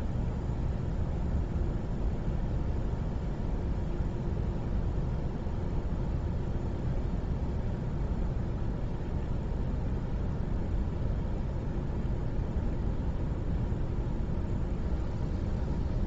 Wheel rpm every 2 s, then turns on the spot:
0, 0, 0, 0, 0, 0, 0, 0.
none